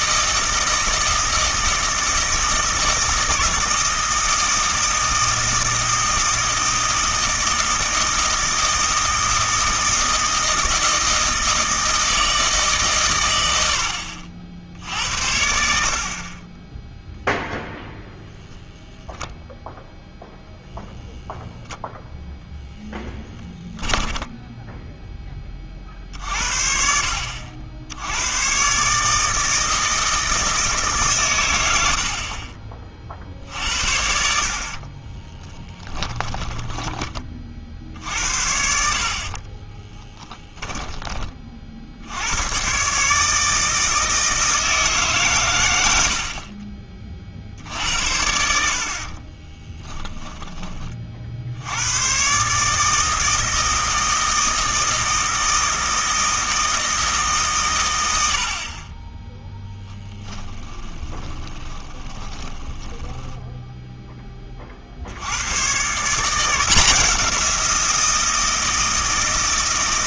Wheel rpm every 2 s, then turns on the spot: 160, 160, 160, 160, 160, 160, 150, 70, 10, 0, 0, 10, 10, 60, 140, 150, 40, 30, 20, 50, 10, 130, 160, 40, 70, 20, 150, 160, 160, 30, 20, 10, 40, 170, 160.
22-26 34-36 40-42 60-64